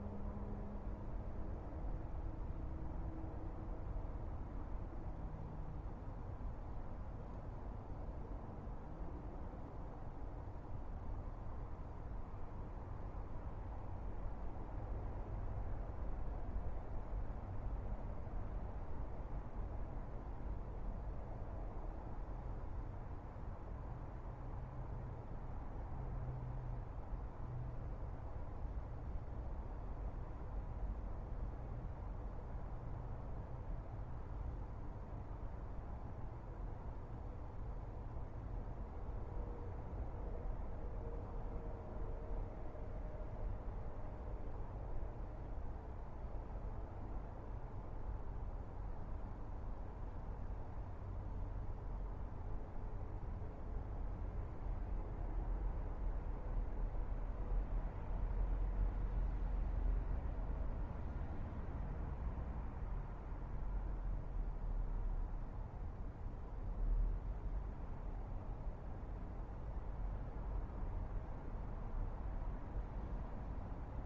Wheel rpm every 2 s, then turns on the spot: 0, 0, 0, 0, 0, 0, 0, 0, 0, 0, 0, 0, 0, 0, 0, 0, 0, 0, 0, 0, 0, 0, 0, 0, 0, 0, 0, 0, 0, 0, 0, 0, 0, 0, 0, 0, 0.
none